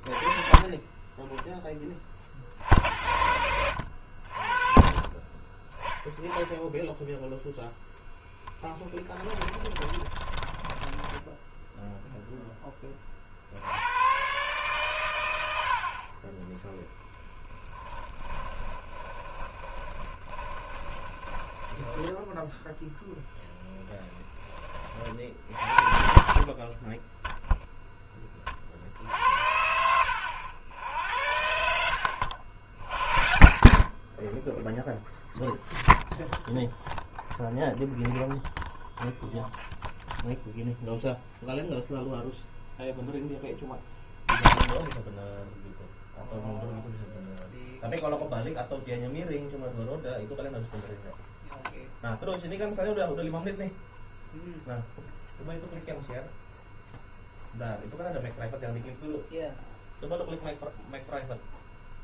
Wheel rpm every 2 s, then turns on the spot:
20, 40, 30, 0, 10, 10, 30, 120, 0, 20, 20, 10, 30, 10, 60, 80, 90, 0, 0, 0, 0, 0, 20, 0, 0, 0, 0, 0, 0, 0, 0.
8-12 18-22